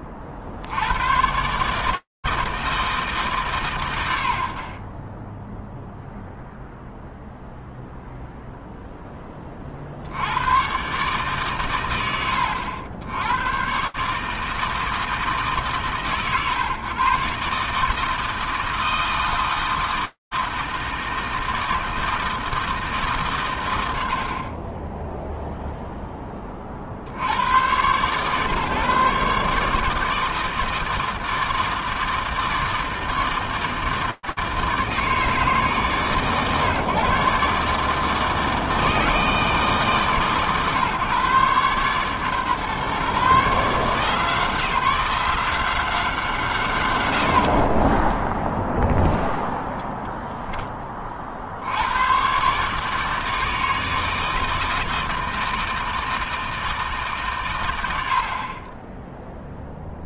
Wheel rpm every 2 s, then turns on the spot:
50, 160, 50, 0, 0, 90, 80, 160, 120, 160, 160, 160, 10, 20, 140, 160, 160, 150, 130, 160, 140, 130, 170, 180, 0, 10, 140, 160, 160, 30.
none